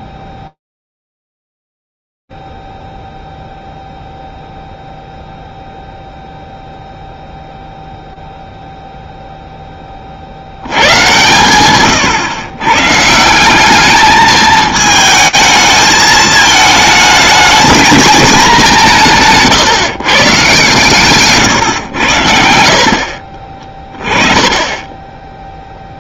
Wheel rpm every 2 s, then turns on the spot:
0, 0, 0, 0, 0, 0, 140, 170, 220, 220, 150, 130, 30.
20-22